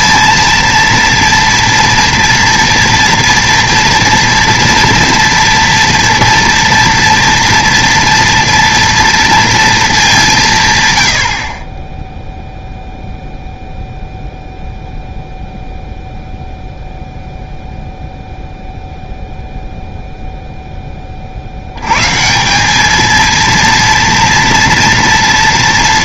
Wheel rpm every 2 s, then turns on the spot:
230, 240, 240, 240, 230, 130, 0, 0, 0, 0, 10, 190, 230.
none